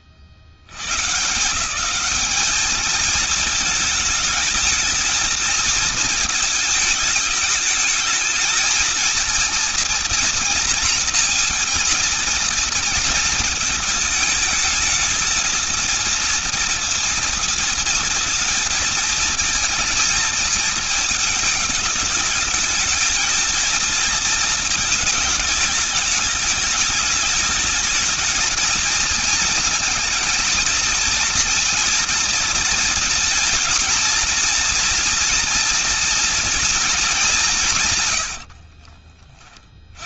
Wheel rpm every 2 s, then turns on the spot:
80, 210, 220, 220, 220, 230, 230, 220, 230, 230, 220, 220, 220, 210, 220, 240, 230, 230, 230, 70.
38-40